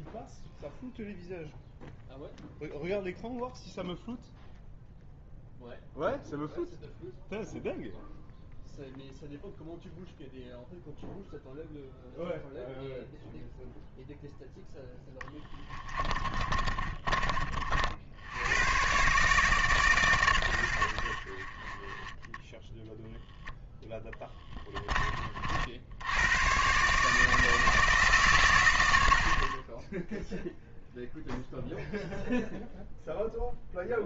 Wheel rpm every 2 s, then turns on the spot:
0, 0, 0, 0, 0, 0, 0, 10, 30, 120, 70, 0, 20, 140, 100, 0, 0.
16-18